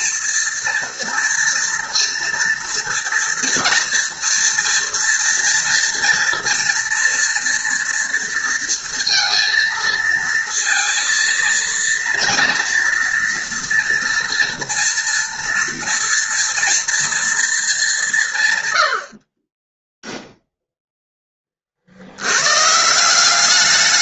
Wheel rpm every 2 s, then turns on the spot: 230, 230, 230, 230, 230, 230, 230, 230, 230, 90, 0, 160.
none